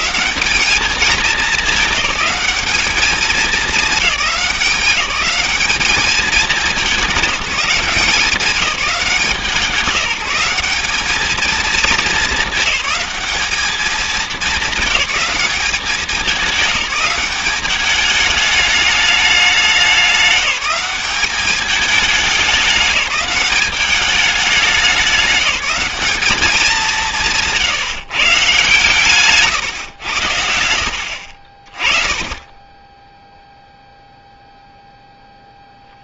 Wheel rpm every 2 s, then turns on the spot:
210, 210, 190, 200, 190, 200, 200, 210, 200, 210, 190, 200, 210, 200, 140, 80, 10, 0.
none